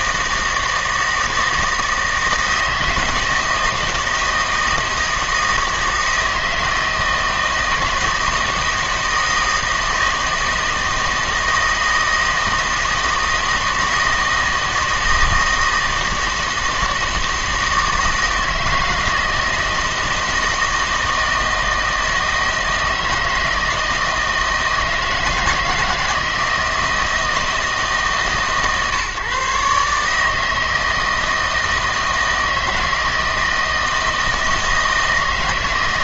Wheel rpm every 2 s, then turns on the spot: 160, 160, 160, 160, 160, 160, 160, 160, 160, 160, 160, 160, 160, 160, 140, 160, 160, 160.
none